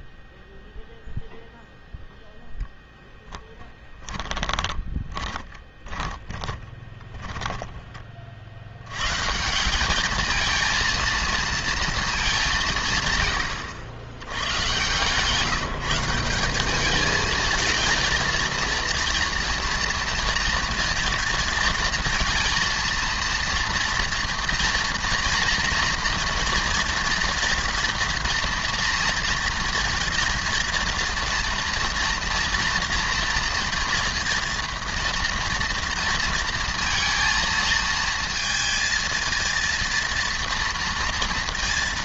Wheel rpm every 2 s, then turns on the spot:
0, 0, 20, 20, 90, 220, 140, 140, 210, 230, 230, 230, 230, 230, 230, 230, 240, 230, 230, 230, 230.
4-8